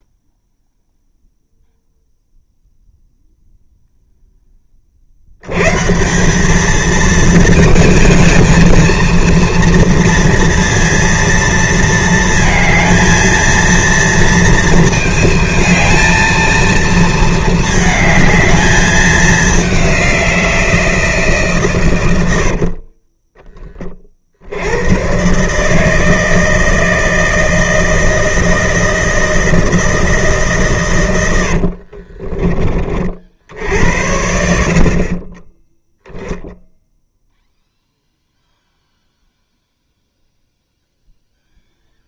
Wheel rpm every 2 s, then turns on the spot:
0, 0, 40, 220, 230, 230, 230, 220, 230, 210, 170, 50, 100, 160, 160, 120, 40, 50, 0, 0, 0.
22-24